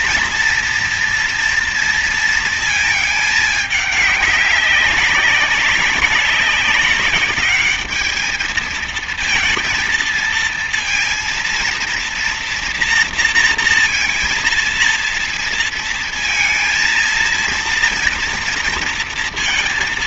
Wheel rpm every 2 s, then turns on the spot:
230, 220, 200, 200, 220, 230, 230, 230, 230, 230.
none